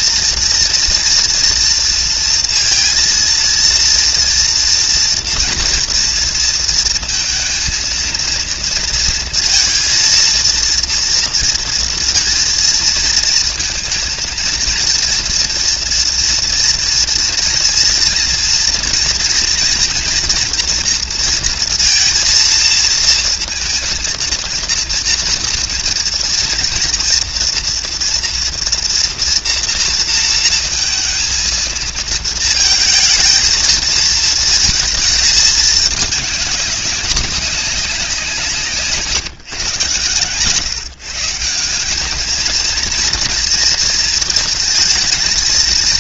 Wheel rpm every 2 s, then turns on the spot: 230, 230, 230, 230, 230, 230, 220, 230, 240, 230, 230, 230, 230, 230, 230, 230, 220, 220, 200, 170, 130, 220, 230.
none